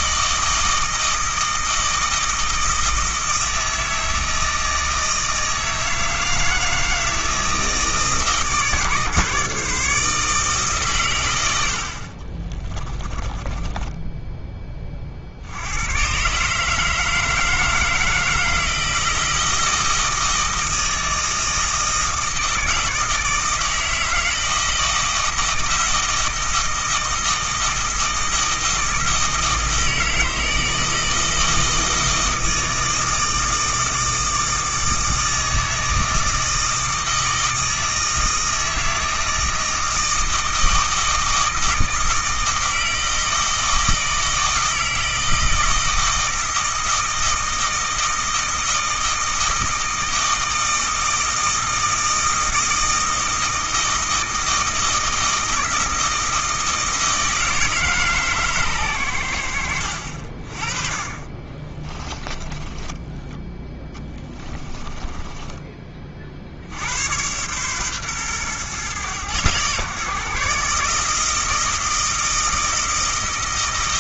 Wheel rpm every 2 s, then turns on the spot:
160, 160, 160, 160, 140, 140, 30, 30, 160, 160, 160, 160, 160, 160, 160, 160, 160, 160, 160, 160, 160, 160, 160, 160, 160, 160, 160, 160, 160, 120, 40, 20, 20, 90, 120, 150, 160.
12-14 62-66